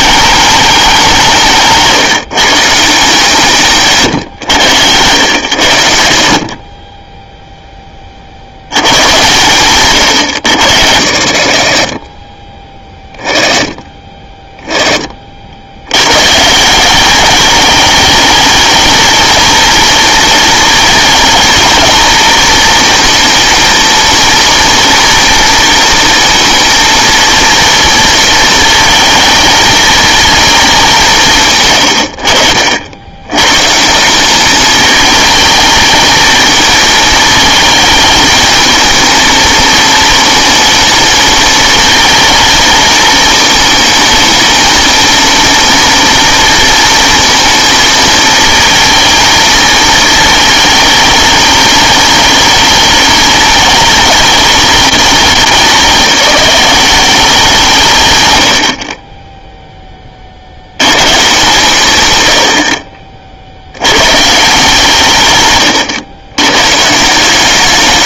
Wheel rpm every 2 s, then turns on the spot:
210, 160, 110, 50, 80, 90, 20, 20, 150, 220, 220, 220, 240, 230, 230, 210, 80, 210, 220, 220, 220, 220, 230, 230, 220, 220, 210, 210, 190, 80, 80, 70, 150, 120.
none